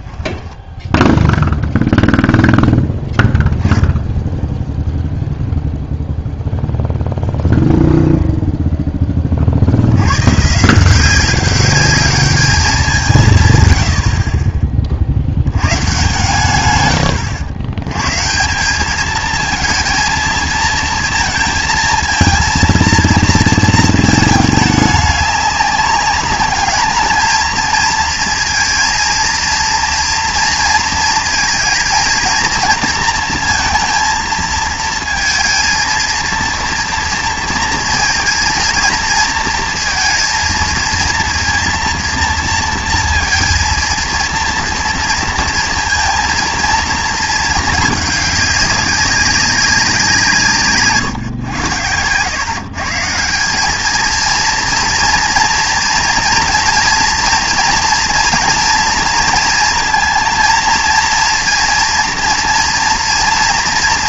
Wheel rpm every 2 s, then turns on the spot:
20, 0, 0, 0, 0, 160, 200, 30, 110, 190, 230, 230, 210, 210, 230, 230, 230, 230, 230, 230, 230, 230, 230, 230, 200, 150, 140, 230, 230, 230, 230, 230.
0-2 50-52